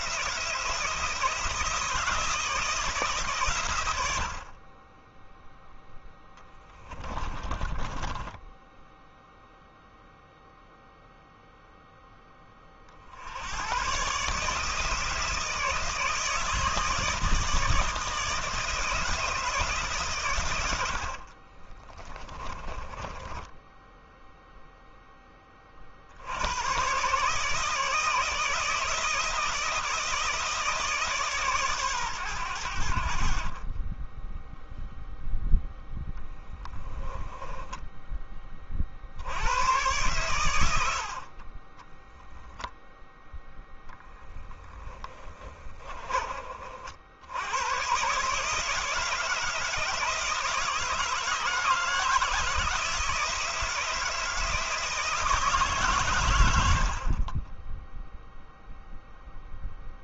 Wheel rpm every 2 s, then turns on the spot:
160, 160, 20, 30, 10, 0, 40, 160, 160, 160, 70, 20, 10, 120, 160, 150, 70, 0, 10, 60, 80, 0, 20, 60, 150, 160, 160, 160, 50, 0.
6-8 20-24 36-38 44-46 56-58